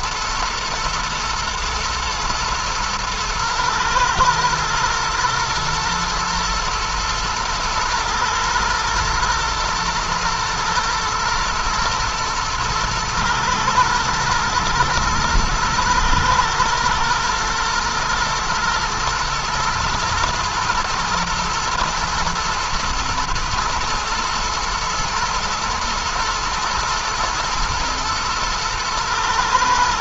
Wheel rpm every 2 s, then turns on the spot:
110, 110, 120, 110, 120, 110, 110, 120, 120, 110, 110, 110, 120, 120, 110.
none